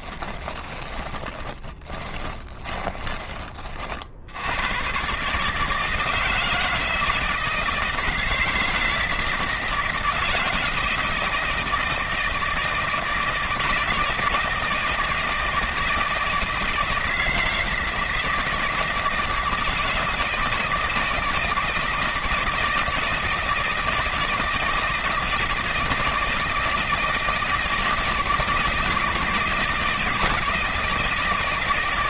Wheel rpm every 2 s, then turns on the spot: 20, 30, 130, 160, 160, 160, 160, 160, 160, 160, 160, 160, 160, 160, 160, 160.
0-4